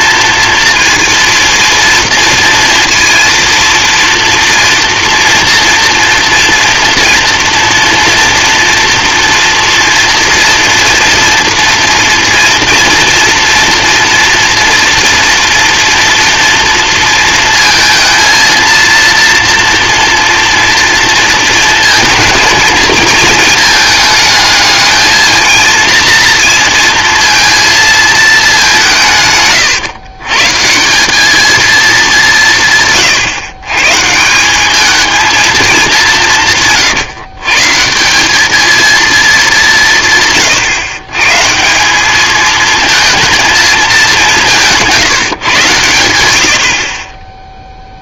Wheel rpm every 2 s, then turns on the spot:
230, 230, 230, 230, 240, 230, 230, 230, 230, 230, 230, 230, 210, 230, 200, 150, 160, 190, 150, 220, 140, 230, 180, 70.
44-46